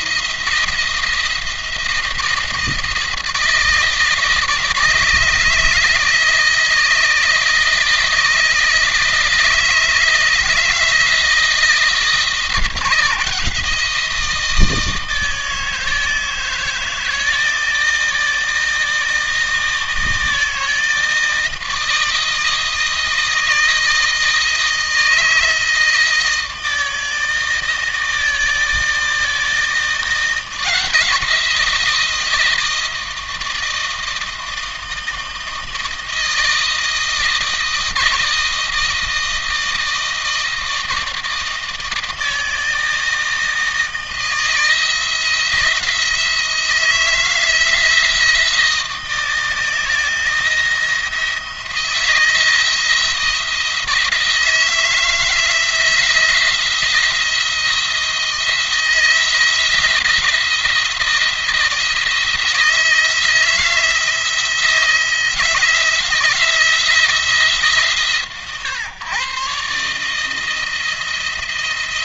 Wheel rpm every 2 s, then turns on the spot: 170, 160, 160, 160, 160, 160, 160, 160, 160, 160, 160, 160, 160, 160, 160, 160, 160, 160, 160, 160, 160, 160, 160, 160, 170, 170, 160, 160, 170, 170, 170, 160, 160, 160, 120, 160.
none